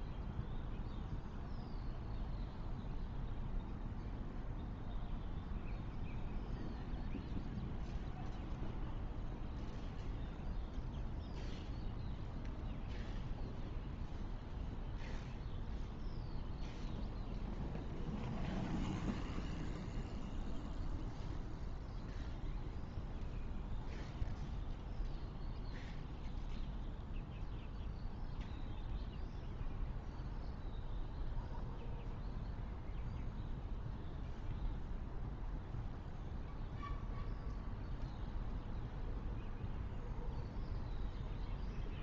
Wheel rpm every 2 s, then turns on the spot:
0, 0, 0, 0, 0, 0, 0, 0, 0, 0, 0, 0, 0, 0, 0, 0, 0, 0, 0, 0, 0.
none